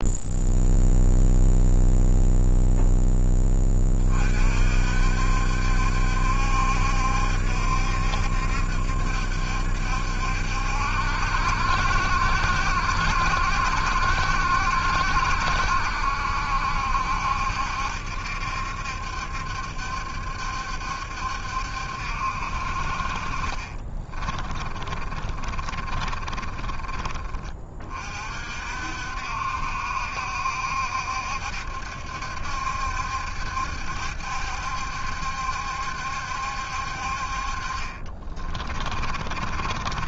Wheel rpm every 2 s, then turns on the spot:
0, 0, 60, 70, 70, 70, 70, 60, 70, 70, 70, 50, 30, 20, 60, 70, 70, 70, 60, 30.
24-28 38-40